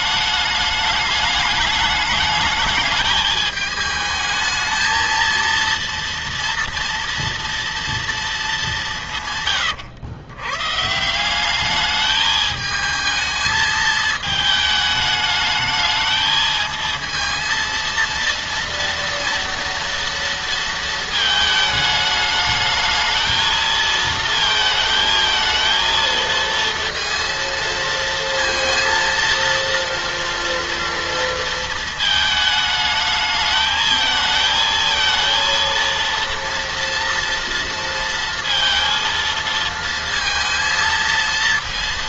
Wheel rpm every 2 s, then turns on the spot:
210, 210, 220, 240, 210, 120, 220, 220, 220, 230, 230, 220, 220, 230, 230, 240, 220, 220, 230, 230, 230.
none